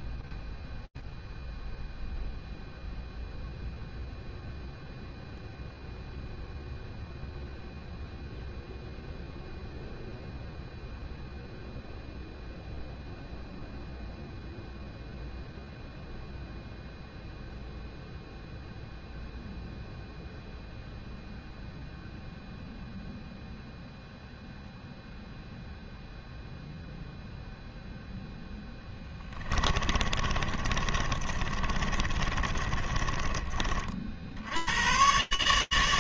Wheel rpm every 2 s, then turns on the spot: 0, 0, 0, 0, 0, 0, 0, 0, 0, 0, 0, 0, 0, 10, 30, 20, 90, 150.
28-32